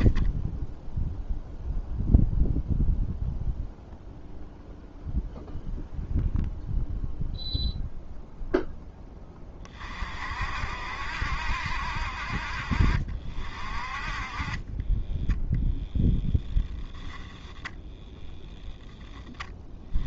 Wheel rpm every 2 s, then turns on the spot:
0, 0, 0, 0, 20, 70, 50, 10, 0, 10.
none